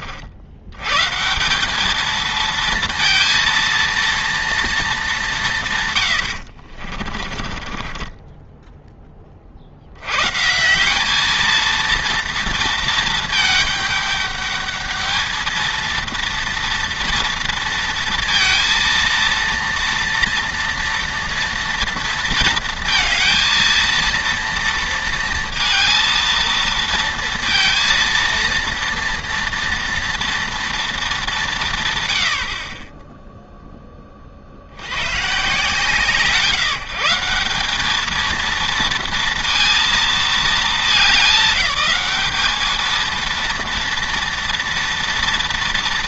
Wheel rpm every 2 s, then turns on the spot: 100, 230, 230, 70, 10, 160, 230, 210, 230, 230, 230, 230, 230, 230, 230, 230, 40, 80, 160, 230, 210, 210, 230.
6-10